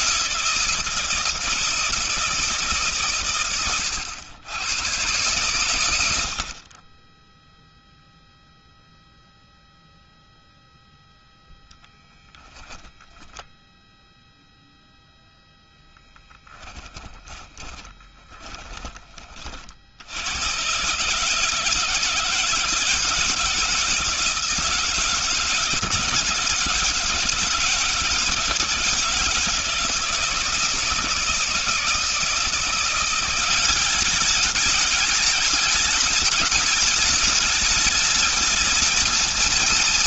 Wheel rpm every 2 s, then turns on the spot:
160, 140, 110, 30, 0, 0, 10, 0, 10, 20, 140, 160, 160, 160, 170, 160, 170, 210, 210, 220.
16-18